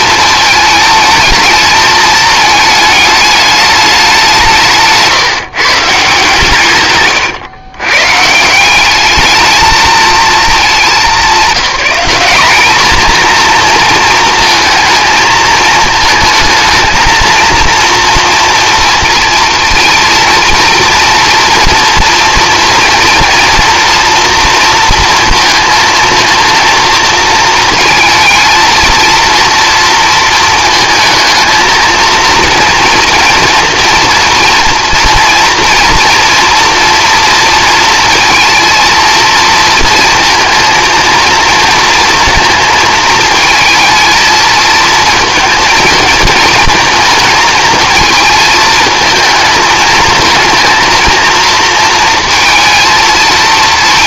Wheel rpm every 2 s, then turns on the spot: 220, 210, 170, 140, 190, 210, 210, 230, 230, 230, 230, 240, 230, 230, 230, 220, 230, 230, 240, 230, 230, 220, 230, 220, 220, 230, 230.
6-8